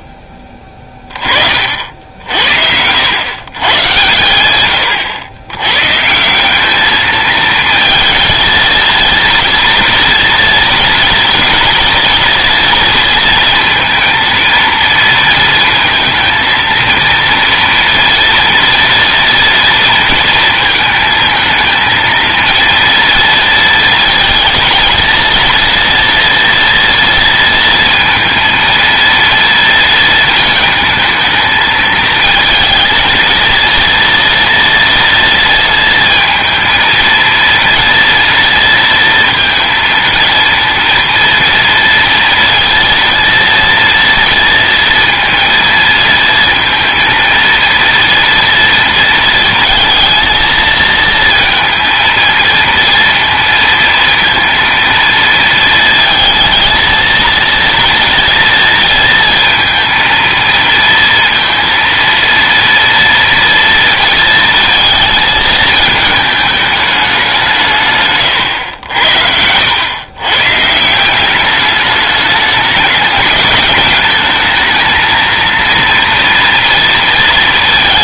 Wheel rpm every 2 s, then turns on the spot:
30, 90, 110, 210, 230, 230, 230, 230, 230, 230, 220, 230, 230, 240, 230, 220, 220, 230, 230, 230, 230, 230, 230, 230, 230, 220, 230, 230, 230, 230, 230, 230, 230, 210, 90, 160, 210, 220, 230.
68-70